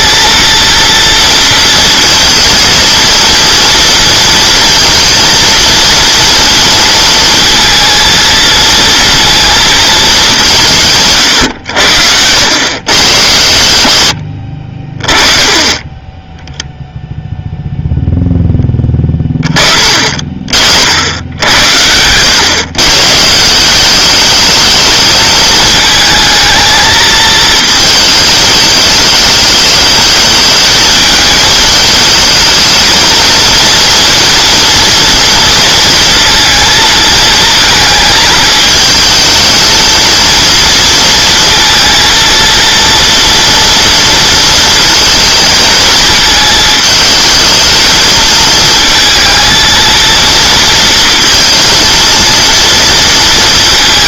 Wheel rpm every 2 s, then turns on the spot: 230, 230, 230, 230, 230, 170, 110, 40, 0, 10, 50, 130, 220, 220, 210, 220, 230, 230, 230, 220, 230, 230, 230, 220, 220, 230, 230.
none